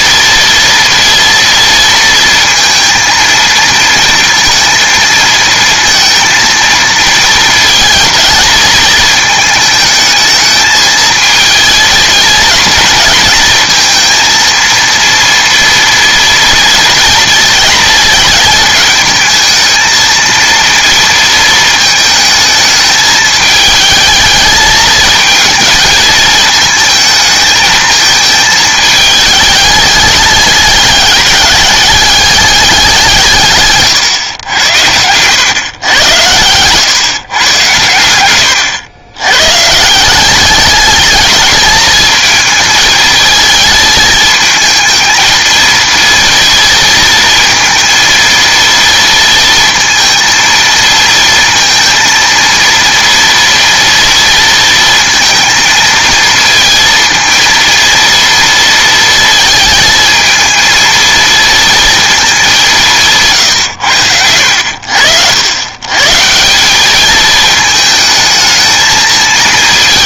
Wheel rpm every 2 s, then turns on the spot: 230, 230, 230, 220, 220, 220, 230, 230, 230, 220, 230, 220, 220, 220, 220, 210, 200, 100, 120, 110, 210, 230, 220, 230, 230, 230, 230, 230, 230, 230, 230, 180, 80, 190, 220.
none